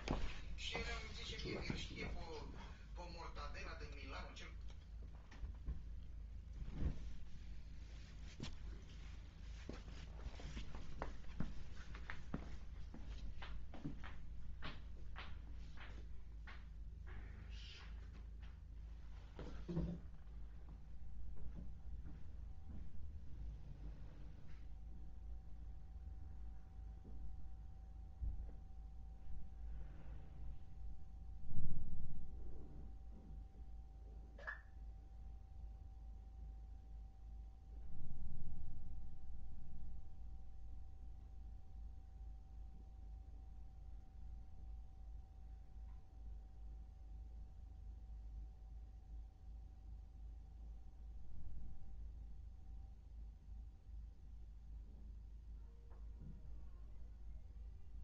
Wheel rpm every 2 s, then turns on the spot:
0, 0, 0, 0, 0, 0, 0, 0, 0, 0, 0, 0, 0, 0, 0, 0, 0, 0, 0, 0, 0, 0, 0, 0, 0, 0, 0, 0, 0.
none